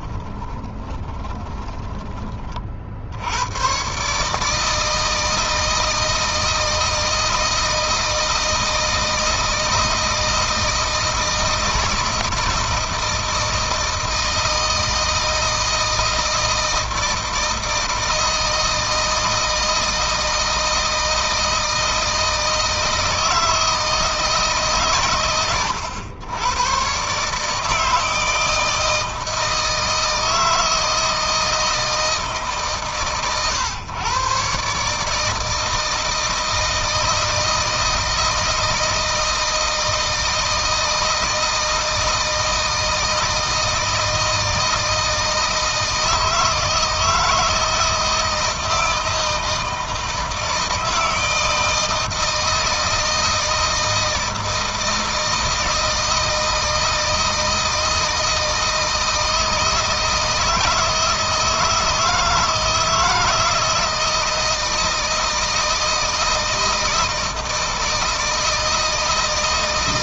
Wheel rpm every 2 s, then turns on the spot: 20, 50, 160, 160, 160, 160, 160, 160, 160, 160, 160, 160, 140, 120, 160, 160, 140, 140, 160, 160, 160, 160, 160, 160, 160, 160, 160, 160, 160, 160, 160, 160, 160, 160, 160.
0-2